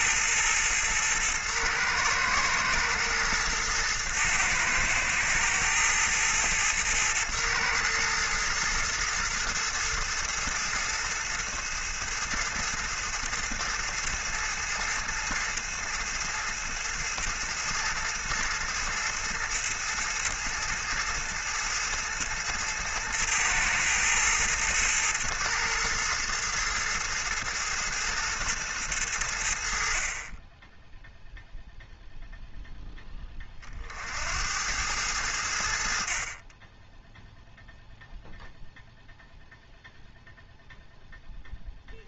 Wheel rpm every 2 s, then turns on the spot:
120, 110, 110, 110, 110, 110, 110, 110, 110, 110, 110, 110, 110, 110, 110, 10, 0, 90, 20, 0, 0.
none